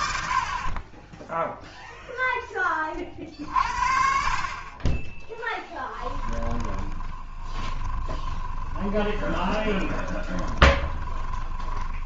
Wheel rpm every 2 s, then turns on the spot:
30, 30, 30, 20, 20, 10.
6-12